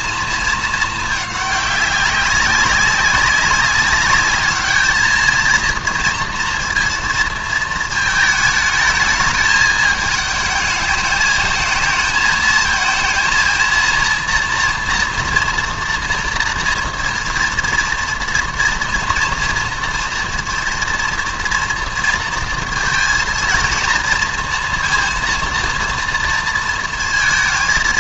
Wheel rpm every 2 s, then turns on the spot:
220, 190, 210, 230, 220, 210, 230, 230, 230, 230, 230, 230, 230, 230.
none